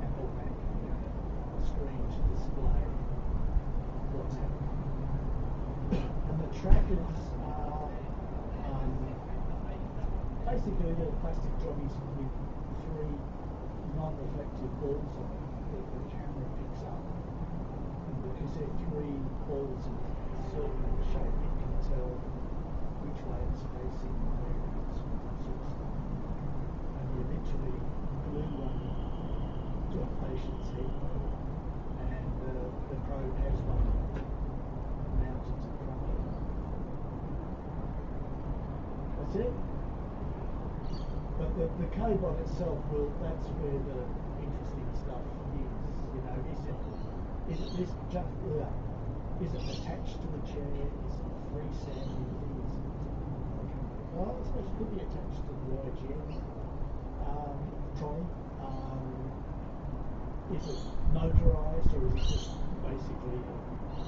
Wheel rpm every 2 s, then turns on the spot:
0, 0, 0, 0, 0, 0, 0, 0, 0, 0, 0, 0, 0, 0, 0, 0, 0, 0, 0, 0, 0, 0, 0, 0, 0, 0, 0, 0, 0, 0, 0, 0.
none